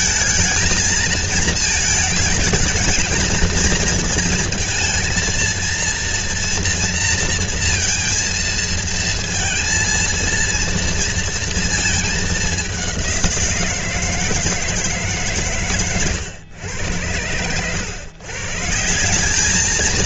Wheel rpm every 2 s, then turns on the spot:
230, 230, 230, 230, 230, 230, 190, 160, 100, 170.
none